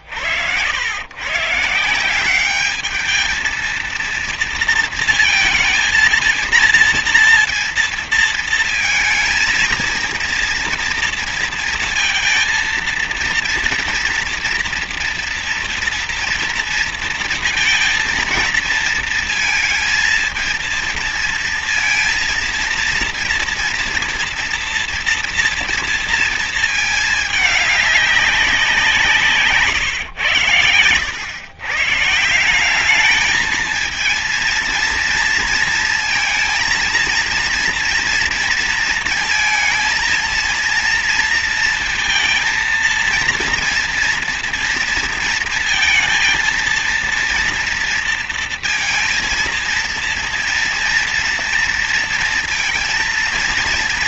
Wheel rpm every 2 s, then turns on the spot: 100, 200, 230, 230, 230, 230, 230, 240, 230, 230, 230, 230, 240, 220, 180, 110, 190, 230, 230, 230, 230, 230, 230, 230, 230, 230, 230.
none